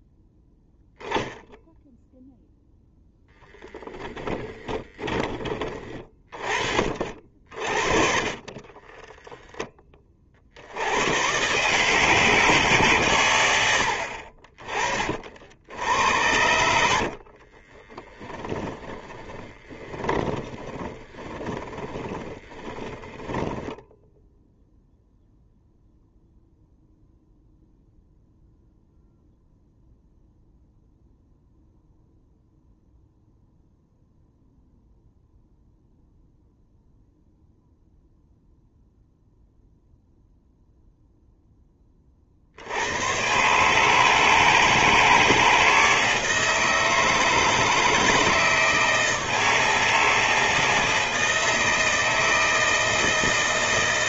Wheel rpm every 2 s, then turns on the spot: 0, 0, 30, 40, 30, 80, 150, 40, 80, 10, 20, 20, 0, 0, 0, 0, 0, 0, 0, 0, 0, 70, 160, 160, 160, 160, 160.
4-6 8-10 16-24